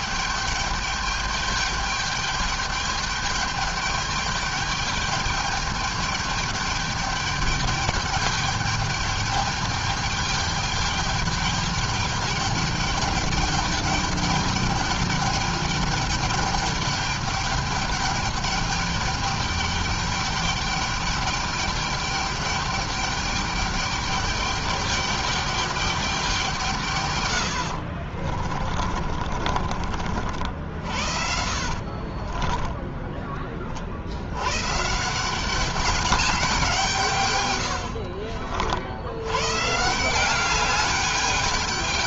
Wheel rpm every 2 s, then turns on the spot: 210, 210, 210, 210, 210, 210, 210, 210, 210, 200, 210, 210, 210, 160, 40, 70, 30, 130, 190, 60, 200.
28-30 32-34